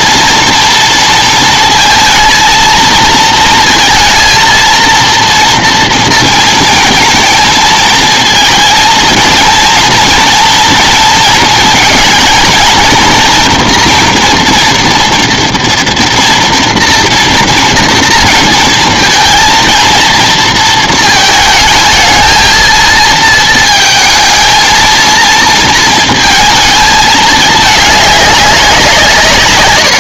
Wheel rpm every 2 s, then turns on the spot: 230, 230, 230, 230, 230, 230, 230, 240, 230, 230, 230, 220, 220, 220, 180.
none